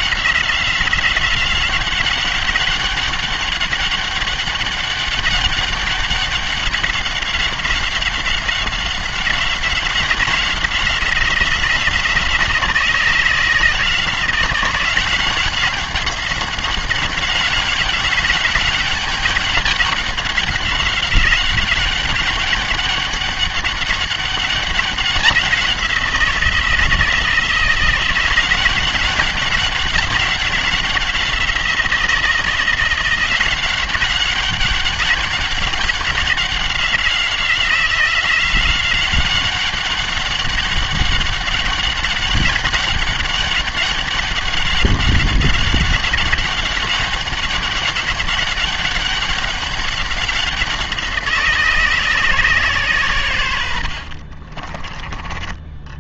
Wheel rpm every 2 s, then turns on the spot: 180, 190, 200, 190, 190, 180, 170, 180, 190, 200, 190, 200, 190, 160, 190, 190, 180, 200, 190, 180, 200, 200, 200, 190, 200, 180, 120, 30.
54-56